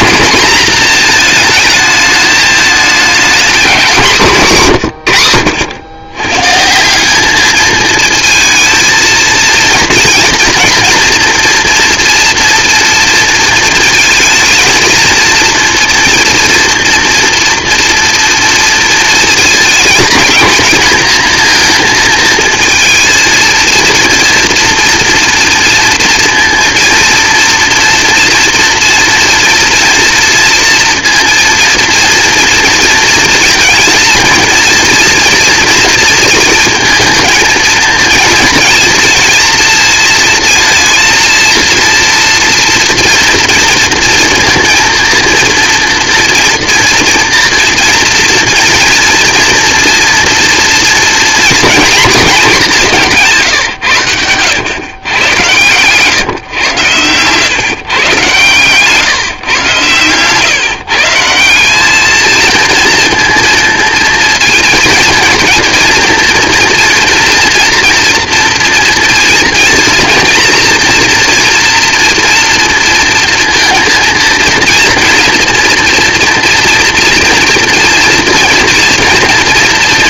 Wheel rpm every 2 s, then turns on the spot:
230, 220, 130, 180, 230, 240, 230, 230, 230, 240, 230, 230, 230, 230, 230, 230, 230, 230, 220, 230, 220, 230, 230, 240, 230, 230, 180, 120, 110, 140, 150, 230, 230, 240, 230, 230, 230, 230, 230, 230.
none